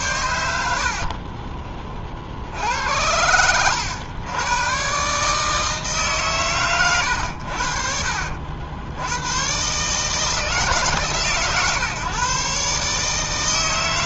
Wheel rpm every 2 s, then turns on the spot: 60, 70, 120, 120, 70, 150, 140.
0-2